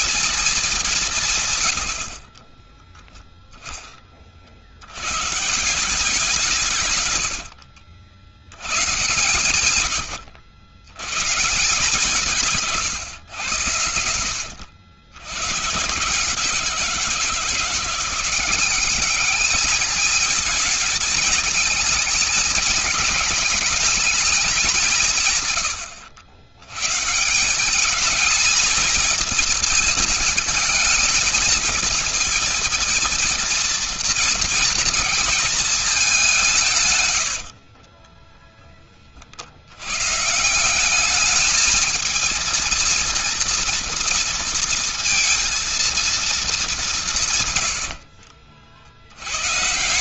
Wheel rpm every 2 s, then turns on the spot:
220, 50, 70, 140, 110, 130, 130, 110, 170, 190, 220, 220, 170, 160, 220, 220, 230, 230, 110, 60, 210, 240, 230, 160, 120.
2-4 36-38 46-48